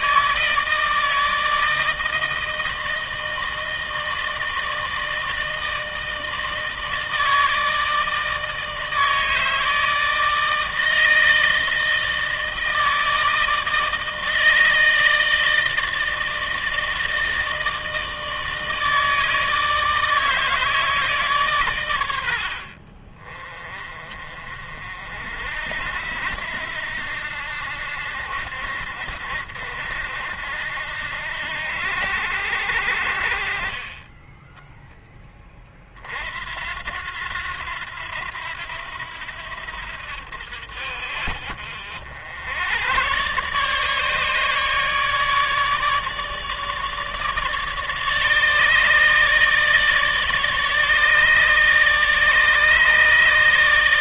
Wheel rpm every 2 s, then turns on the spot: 160, 160, 160, 160, 160, 160, 160, 160, 160, 160, 160, 60, 50, 80, 70, 70, 70, 10, 70, 90, 60, 90, 150, 150, 150, 150, 150.
none